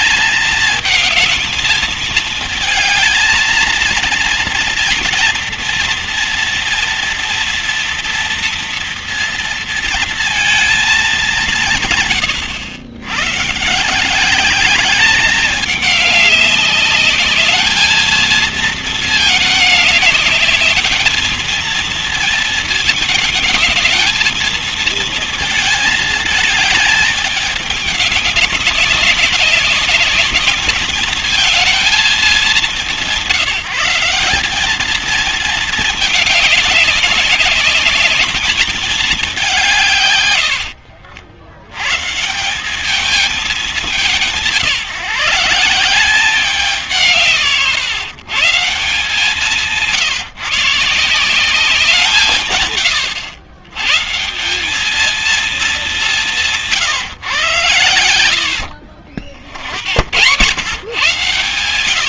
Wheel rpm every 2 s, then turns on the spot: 220, 220, 230, 230, 230, 220, 110, 210, 200, 220, 210, 220, 220, 220, 190, 220, 170, 210, 200, 210, 60, 200, 160, 170, 170, 150, 120, 200, 160, 50, 110.
none